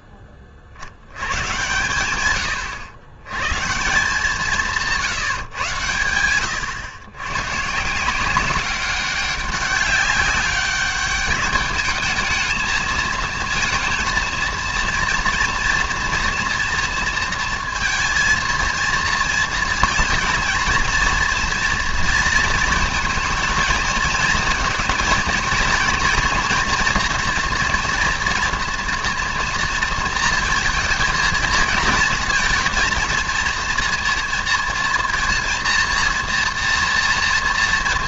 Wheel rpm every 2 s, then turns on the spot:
60, 110, 170, 100, 200, 210, 220, 230, 240, 230, 230, 220, 230, 240, 230, 220, 230, 230, 230.
none